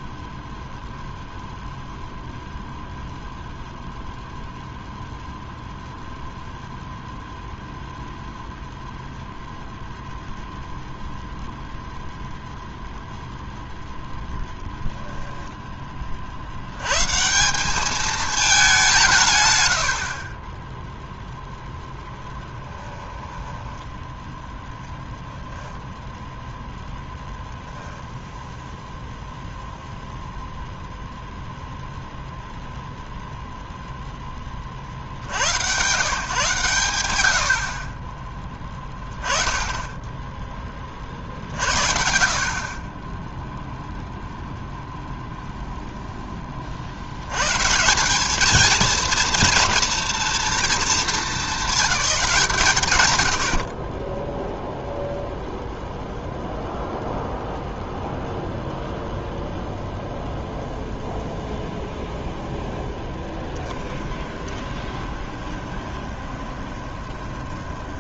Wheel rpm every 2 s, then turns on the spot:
0, 0, 0, 0, 0, 0, 0, 10, 90, 200, 10, 10, 10, 10, 0, 0, 0, 30, 120, 20, 20, 40, 0, 40, 230, 230, 130, 0, 0, 0, 0, 0, 20, 20.
14-16 22-28 64-68